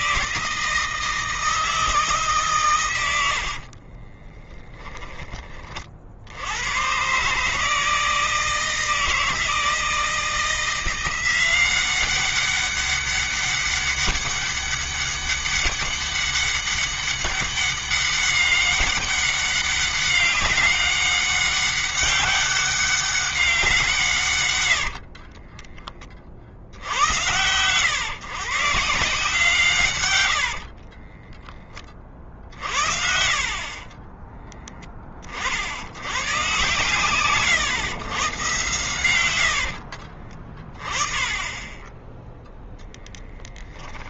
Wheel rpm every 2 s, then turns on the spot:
160, 110, 20, 120, 160, 170, 200, 200, 200, 200, 200, 200, 80, 70, 150, 30, 50, 20, 130, 90, 20, 0.
24-26 30-32